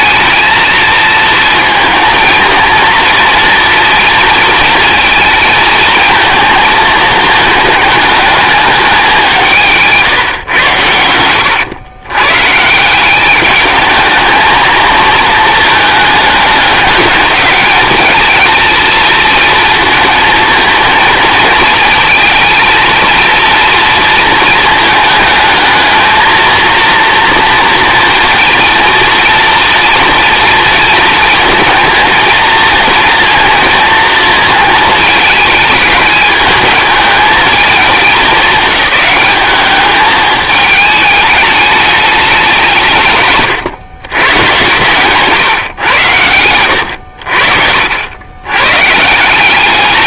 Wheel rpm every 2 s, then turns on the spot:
220, 230, 230, 220, 200, 100, 180, 220, 210, 230, 220, 230, 220, 230, 230, 230, 230, 220, 210, 200, 210, 170, 130, 90, 130.
46-48